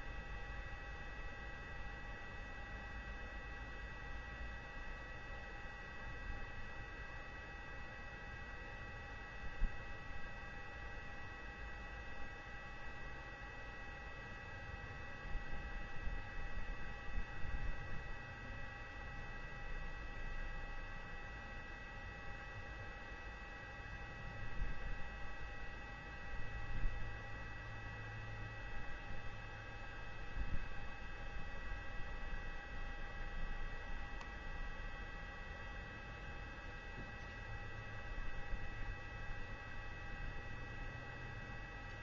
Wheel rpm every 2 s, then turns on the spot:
0, 0, 0, 0, 0, 0, 0, 0, 0, 0, 0, 0, 0, 0, 0, 0, 0, 0, 0, 0, 0.
none